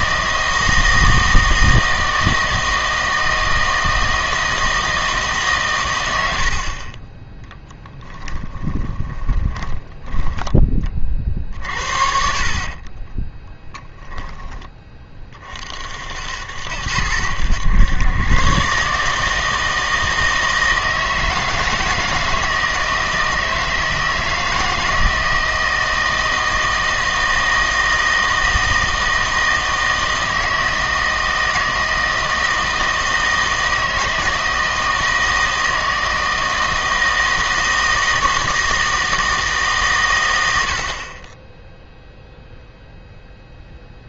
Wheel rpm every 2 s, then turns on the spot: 160, 160, 160, 50, 20, 30, 40, 10, 80, 140, 160, 160, 160, 160, 160, 160, 160, 160, 160, 160, 60, 0.
6-10 12-14